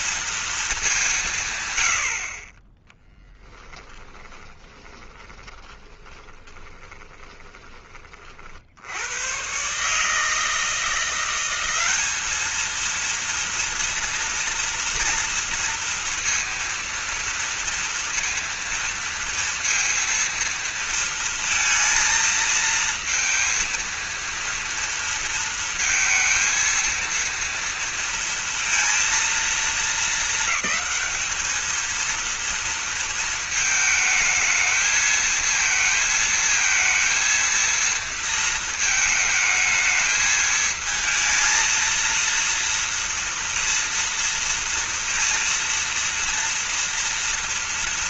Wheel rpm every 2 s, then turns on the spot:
220, 20, 20, 20, 70, 170, 220, 230, 230, 230, 230, 220, 230, 230, 230, 220, 230, 220, 220, 220, 220, 230, 230, 230.
4-8